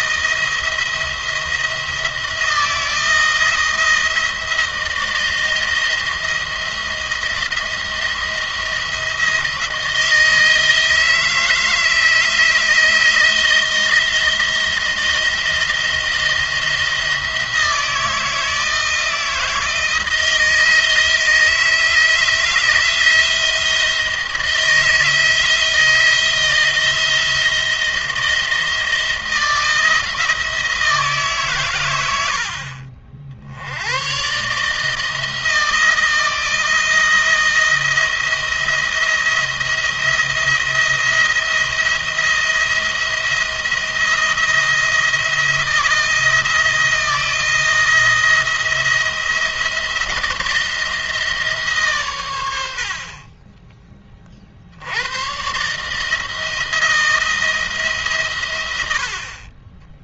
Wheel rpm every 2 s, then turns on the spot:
170, 160, 160, 170, 170, 160, 160, 170, 170, 160, 160, 170, 160, 160, 160, 160, 60, 140, 170, 170, 170, 170, 170, 170, 170, 160, 90, 60, 160, 100.
none